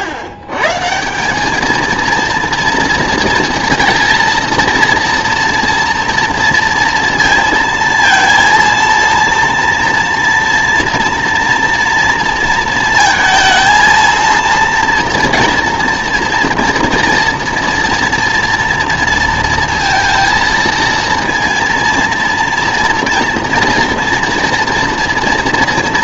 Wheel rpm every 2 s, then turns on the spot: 140, 230, 230, 230, 230, 230, 230, 230, 230, 230, 230, 230, 230.
none